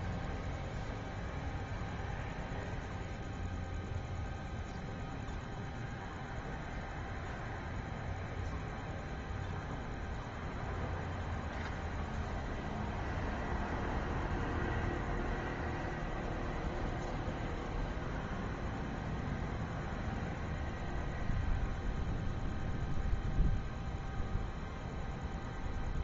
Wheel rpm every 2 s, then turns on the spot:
0, 0, 0, 0, 0, 0, 0, 0, 0, 0, 0, 0, 0.
none